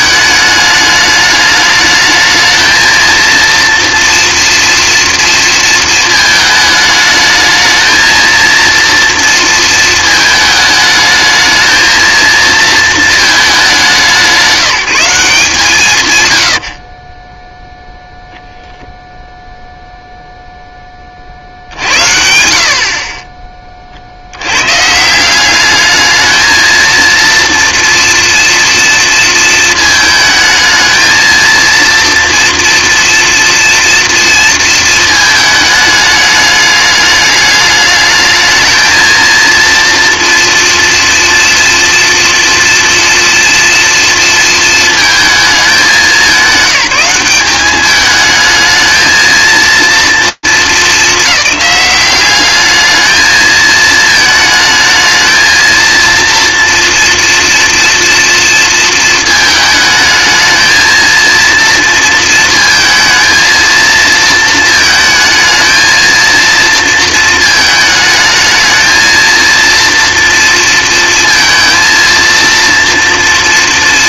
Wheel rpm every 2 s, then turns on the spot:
210, 220, 230, 220, 230, 220, 230, 180, 70, 0, 0, 60, 120, 220, 230, 220, 230, 230, 210, 220, 230, 230, 230, 200, 220, 220, 210, 220, 230, 230, 220, 230, 230, 230, 220, 230, 230.
16-18